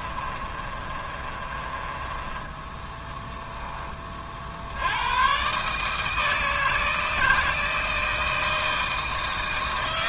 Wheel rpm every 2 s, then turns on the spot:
30, 10, 90, 160, 160.
0-2